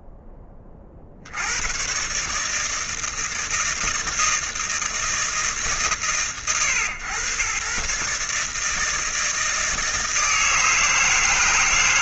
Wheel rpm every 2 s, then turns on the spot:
10, 150, 160, 110, 150, 160.
none